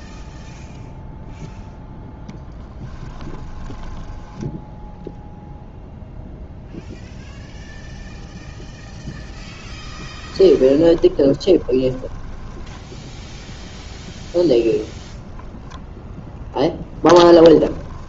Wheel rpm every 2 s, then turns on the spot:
0, 10, 0, 0, 0, 20, 10, 0, 10.
2-4 10-14 16-18